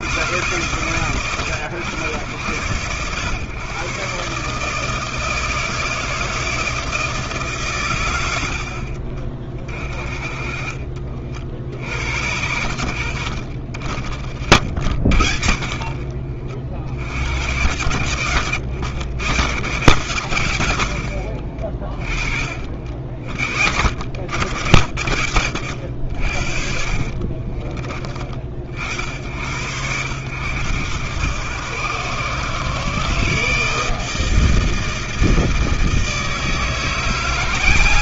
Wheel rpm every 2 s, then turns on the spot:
110, 120, 160, 160, 40, 50, 80, 50, 60, 100, 70, 50, 70, 40, 50, 110, 140, 160, 170.
14-16 18-20 26-28